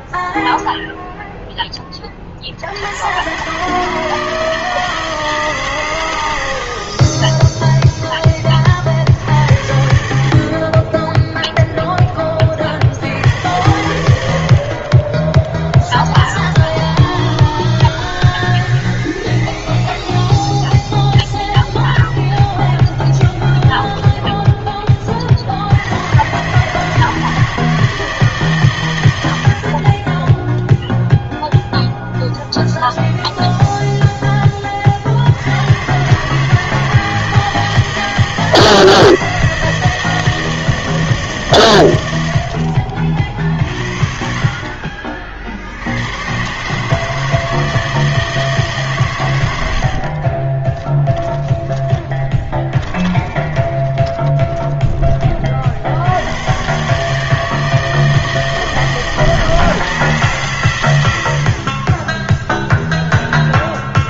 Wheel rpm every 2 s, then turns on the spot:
0, 80, 160, 60, 40, 30, 60, 40, 10, 20, 0, 20, 20, 150, 130, 0, 0, 30, 160, 160, 160, 60, 40, 150, 150, 20, 20, 20, 130, 160, 130, 0.
16-20 22-24 42-44 50-56